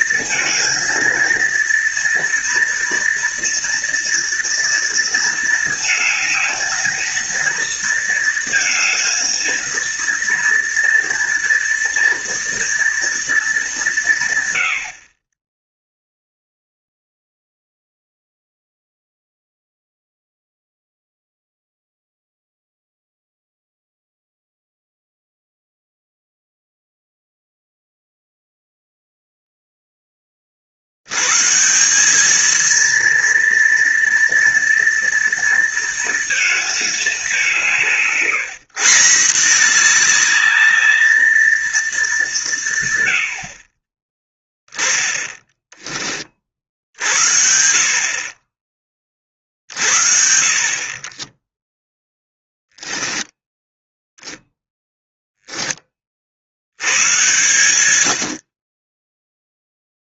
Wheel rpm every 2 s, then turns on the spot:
230, 230, 230, 220, 230, 230, 230, 90, 0, 0, 0, 0, 0, 0, 0, 60, 230, 230, 220, 150, 220, 160, 20, 60, 30, 50, 10, 0, 90, 20.
none